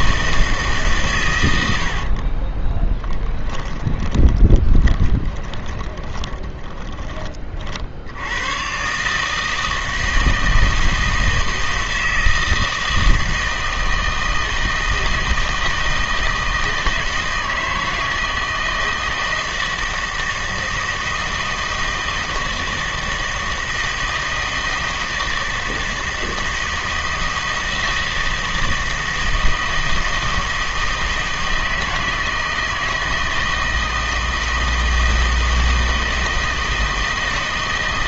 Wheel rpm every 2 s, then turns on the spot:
140, 10, 20, 20, 130, 160, 160, 160, 160, 160, 160, 160, 160, 160, 160, 160, 160, 160, 160.
2-8